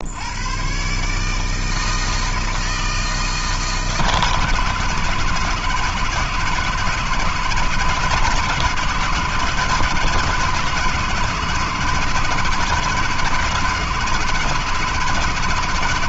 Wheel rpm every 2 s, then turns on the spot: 110, 160, 150, 160, 160, 160, 150, 160.
none